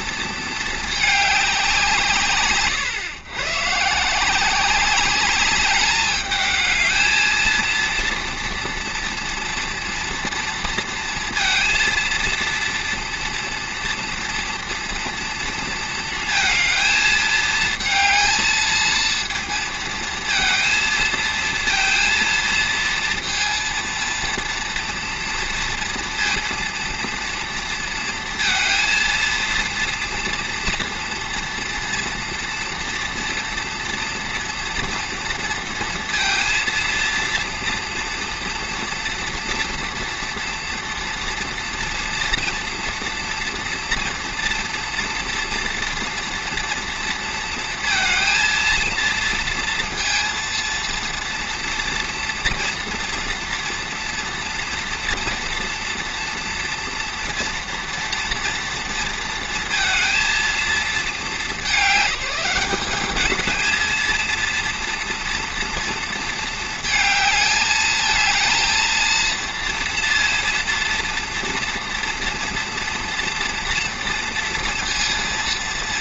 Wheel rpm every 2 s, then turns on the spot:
220, 90, 190, 220, 230, 230, 230, 230, 220, 230, 220, 230, 240, 230, 230, 230, 230, 230, 230, 230, 230, 230, 230, 230, 230, 230, 240, 240, 230, 230, 220, 190, 230, 220, 230, 230, 230, 230.
none